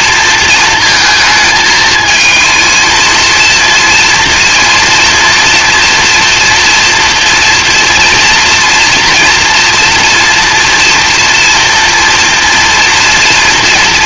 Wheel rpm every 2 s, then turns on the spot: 220, 230, 230, 230, 230, 240, 230.
none